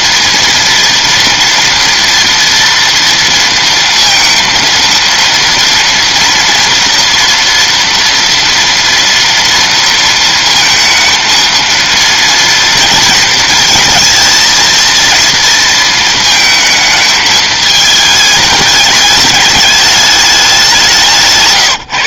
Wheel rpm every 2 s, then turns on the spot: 230, 230, 230, 230, 230, 230, 230, 230, 220, 210, 180.
none